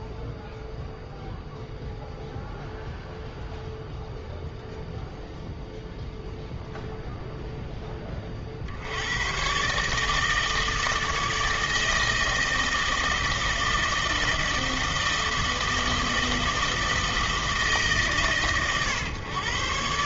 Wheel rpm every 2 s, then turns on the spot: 0, 0, 0, 0, 50, 160, 160, 160, 160, 130.
none